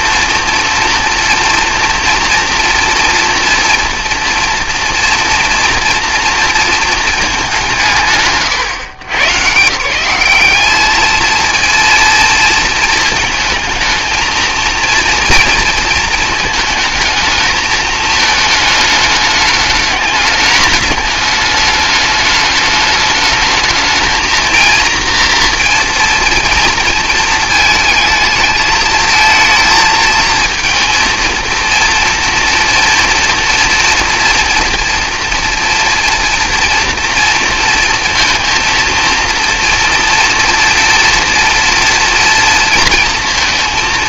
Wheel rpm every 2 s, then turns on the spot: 230, 240, 230, 230, 120, 210, 220, 230, 220, 210, 210, 210, 230, 230, 220, 230, 230, 230, 230, 230, 240, 230.
none